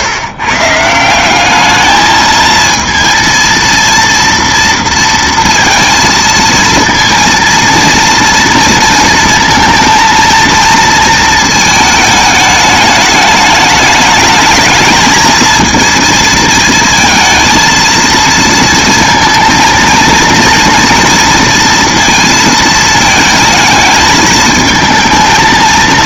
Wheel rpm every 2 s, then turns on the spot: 150, 220, 230, 230, 230, 230, 210, 220, 220, 230, 230, 220, 220.
none